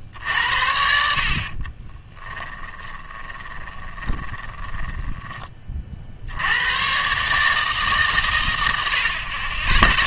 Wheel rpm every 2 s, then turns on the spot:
70, 20, 20, 100, 100.
2-6